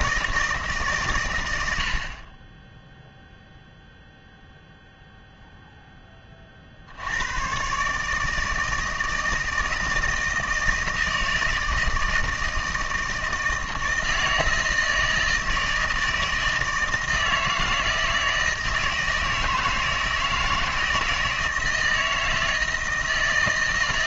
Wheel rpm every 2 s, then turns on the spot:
150, 10, 0, 60, 160, 160, 160, 160, 160, 160, 160, 160.
none